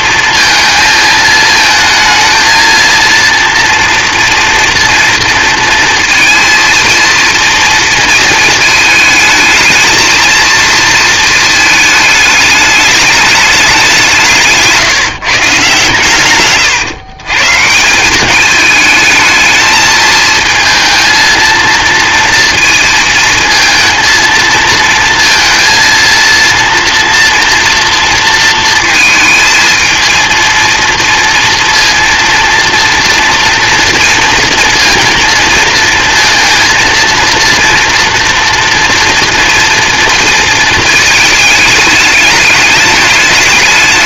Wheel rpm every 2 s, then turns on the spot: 230, 230, 230, 230, 220, 230, 210, 150, 130, 210, 230, 230, 230, 230, 230, 230, 240, 230, 230, 230, 220, 210.
none